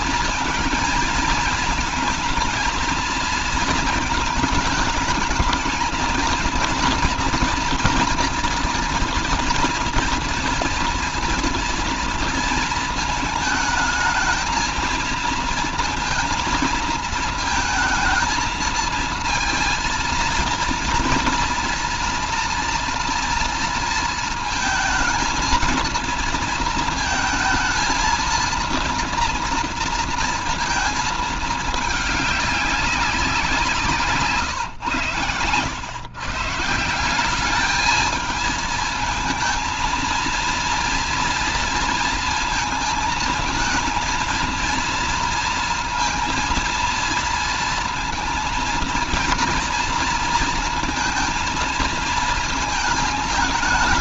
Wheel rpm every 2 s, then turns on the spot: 220, 220, 210, 230, 230, 230, 220, 230, 230, 220, 230, 230, 220, 230, 230, 230, 200, 140, 160, 220, 230, 230, 230, 230, 230, 230, 220.
none